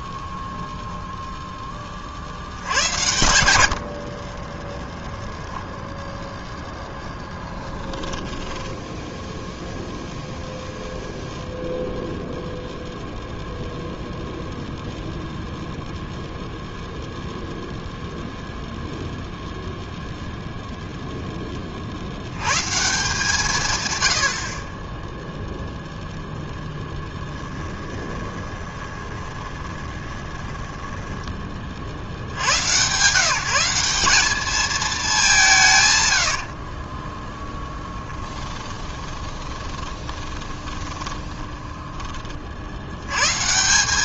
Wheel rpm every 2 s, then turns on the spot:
10, 90, 20, 0, 10, 0, 0, 0, 0, 0, 0, 150, 30, 0, 20, 10, 130, 210, 40, 10, 30, 90.
4-6 8-10 28-32 36-42